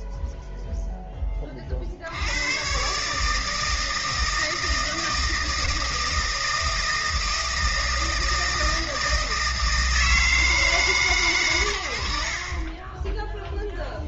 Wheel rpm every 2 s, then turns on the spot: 0, 110, 160, 160, 160, 160, 10.
none